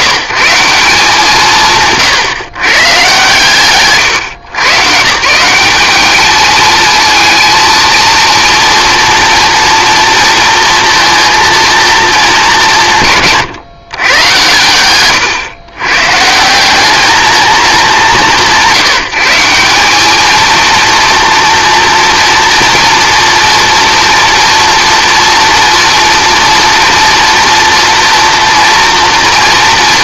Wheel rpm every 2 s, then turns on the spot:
160, 120, 140, 220, 230, 230, 180, 110, 190, 170, 230, 240, 230, 230, 230.
none